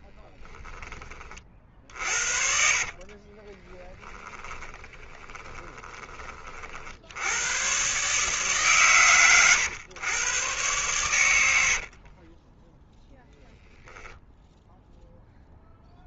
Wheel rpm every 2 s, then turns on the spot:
20, 50, 20, 60, 130, 110, 10, 0.
2-6 12-14